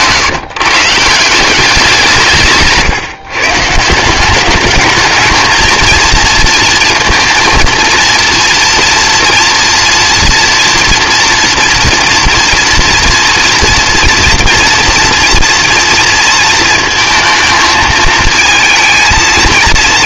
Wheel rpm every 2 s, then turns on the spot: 150, 150, 210, 230, 230, 230, 230, 230, 230, 220.
2-4